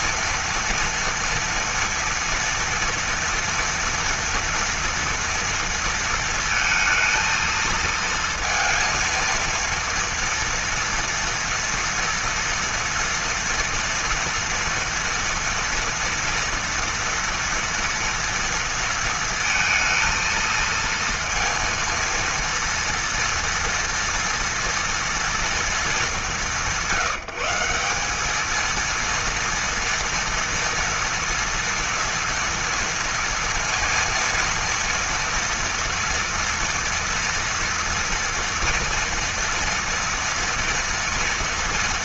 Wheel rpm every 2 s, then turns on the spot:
230, 230, 230, 230, 230, 230, 230, 240, 240, 230, 230, 230, 230, 170, 220, 230, 230, 230, 230, 230, 230.
none